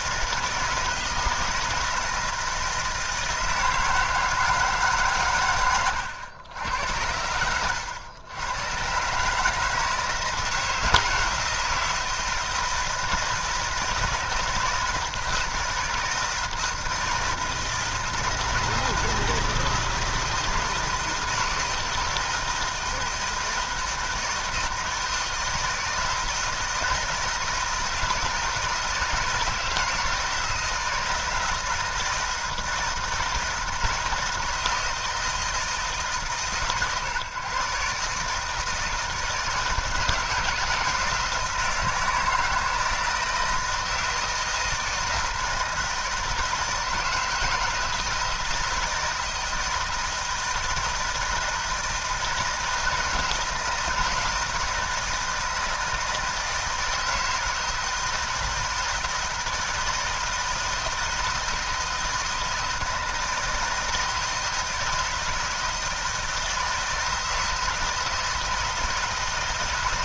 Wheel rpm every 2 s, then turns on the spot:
160, 160, 150, 90, 120, 160, 160, 160, 160, 160, 160, 160, 160, 160, 160, 160, 170, 160, 130, 160, 160, 160, 160, 160, 160, 170, 160, 160, 160, 160, 160, 160, 160, 160, 160.
none